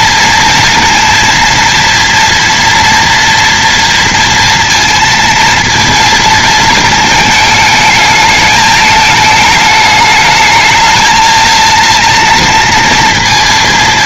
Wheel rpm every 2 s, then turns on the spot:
230, 230, 230, 220, 210, 220, 230.
none